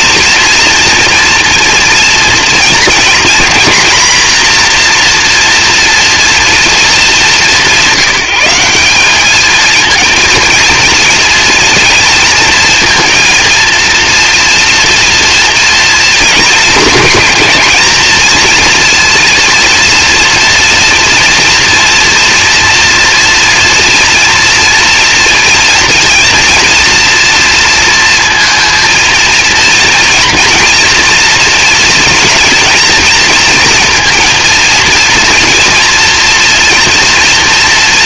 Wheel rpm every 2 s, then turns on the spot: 230, 230, 240, 230, 190, 230, 220, 240, 220, 230, 230, 230, 230, 240, 230, 240, 220, 230, 240.
none